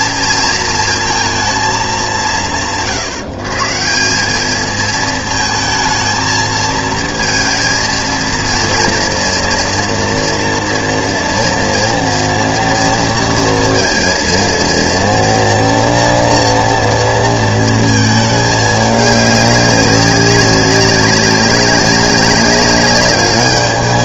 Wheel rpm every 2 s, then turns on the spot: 230, 130, 220, 220, 230, 230, 230, 230, 230, 210, 200, 200.
none